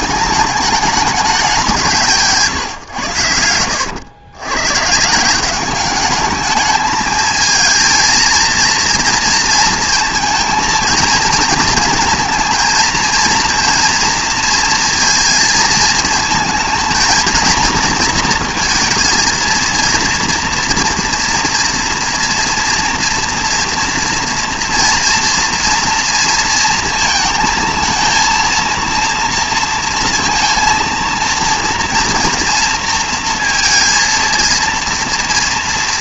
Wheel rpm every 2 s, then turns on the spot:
210, 130, 130, 220, 230, 230, 220, 230, 230, 230, 230, 230, 230, 230, 230, 230, 230, 230.
none